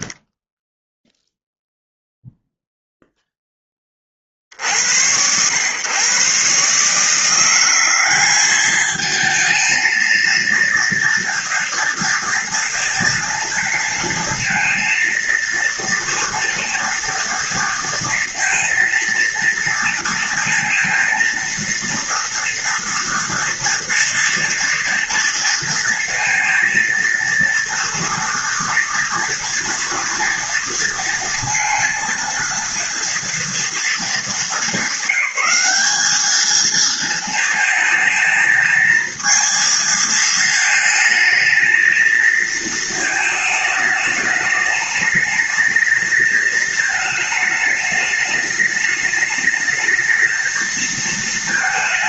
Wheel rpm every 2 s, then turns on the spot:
0, 0, 40, 130, 190, 230, 230, 230, 230, 230, 230, 230, 230, 230, 230, 230, 230, 210, 210, 220, 230, 230, 210, 220, 210, 220.
none